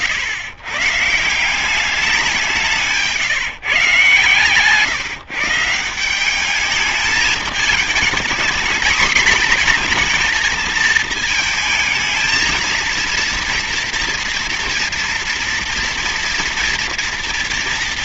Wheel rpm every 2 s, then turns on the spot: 140, 170, 140, 200, 230, 230, 230, 230, 230.
none